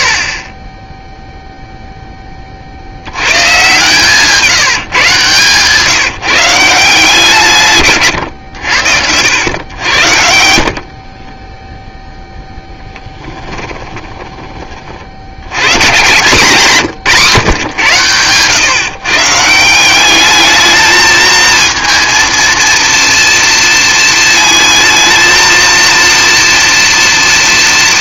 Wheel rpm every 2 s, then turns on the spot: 10, 20, 160, 160, 130, 70, 0, 20, 160, 140, 220, 230, 230, 230.
8-10